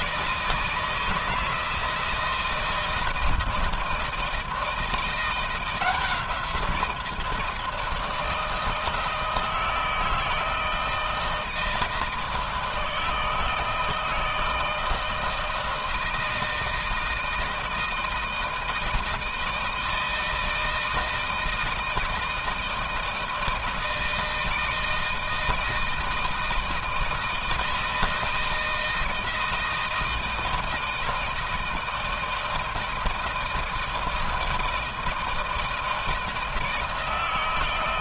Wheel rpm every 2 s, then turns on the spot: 160, 160, 170, 170, 160, 160, 160, 160, 160, 160, 160, 160, 160, 160, 160, 160, 160, 160, 160.
none